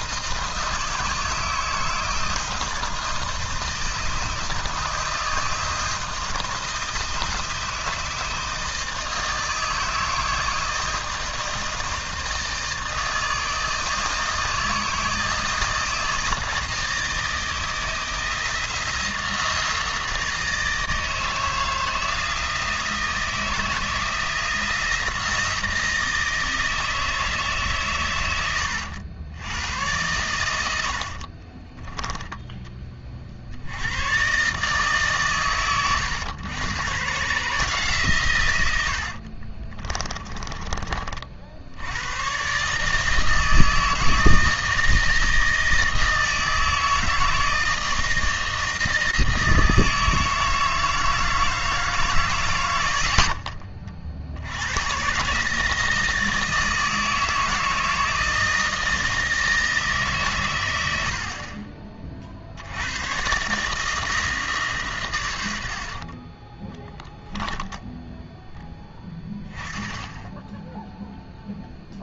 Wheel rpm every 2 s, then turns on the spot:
160, 160, 160, 160, 160, 160, 160, 160, 160, 170, 160, 160, 160, 160, 90, 70, 30, 140, 110, 80, 30, 150, 160, 160, 160, 160, 100, 120, 160, 160, 90, 90, 130, 10, 10, 0.
30-32 66-68